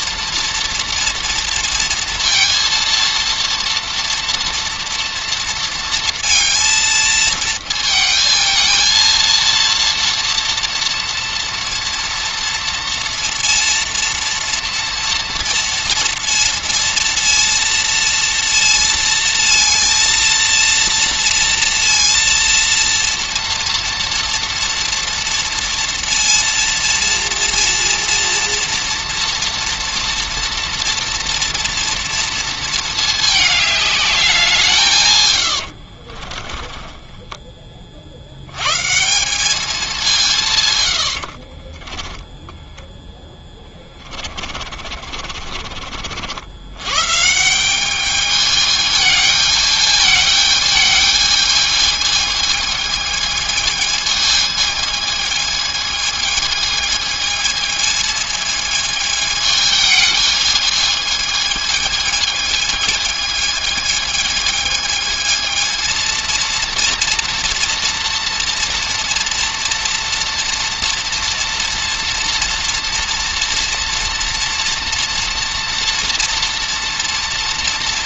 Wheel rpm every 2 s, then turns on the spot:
230, 230, 230, 220, 220, 230, 230, 230, 230, 230, 230, 230, 230, 230, 230, 230, 230, 160, 20, 110, 140, 10, 40, 90, 210, 220, 220, 220, 220, 220, 220, 220, 220, 230, 230, 230, 230, 230, 230.
36-38 42-46